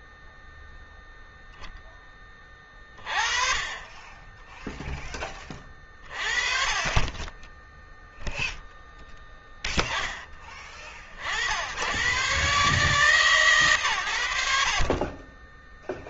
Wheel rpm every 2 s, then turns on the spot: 0, 20, 10, 40, 0, 20, 130, 40.
none